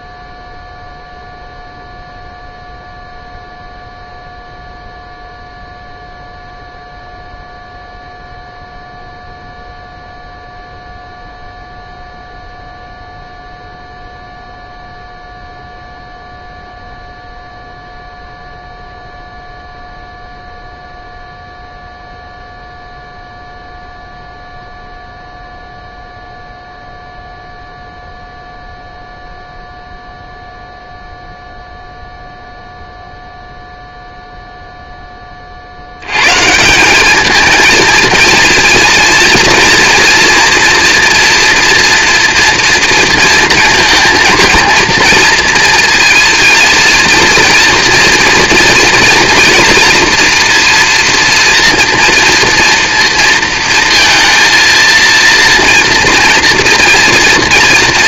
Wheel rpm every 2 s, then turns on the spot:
0, 0, 0, 0, 0, 0, 0, 0, 0, 0, 0, 0, 0, 0, 0, 0, 0, 0, 150, 230, 240, 230, 230, 230, 230, 240, 230, 230, 230.
none